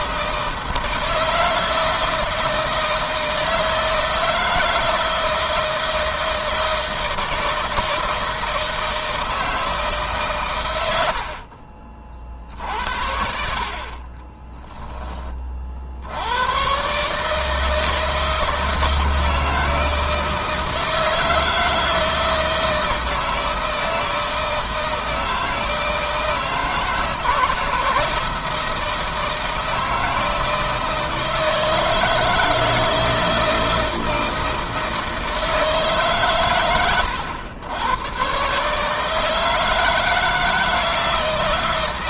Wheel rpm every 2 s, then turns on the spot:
160, 160, 160, 160, 160, 90, 60, 10, 130, 160, 160, 160, 160, 160, 160, 160, 160, 160, 100, 150, 160.
none